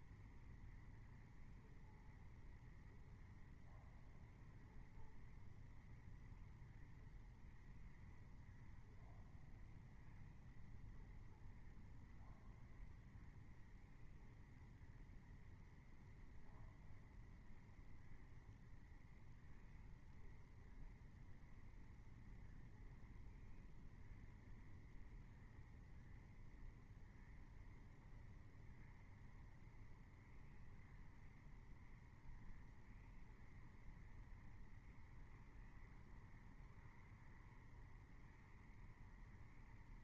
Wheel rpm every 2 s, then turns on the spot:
0, 0, 0, 0, 0, 0, 0, 0, 0, 0, 0, 0, 0, 0, 0, 0, 0, 0, 0, 0.
none